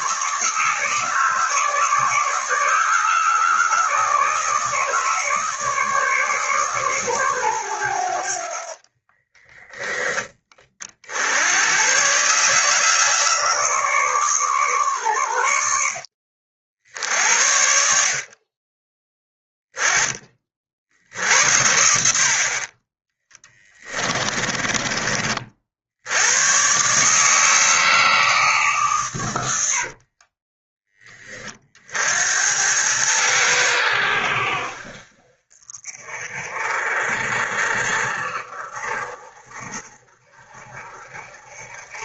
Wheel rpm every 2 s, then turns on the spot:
160, 150, 150, 140, 50, 40, 140, 130, 60, 30, 50, 40, 30, 130, 140, 10, 90, 60, 40, 40, 50.
8-10 24-26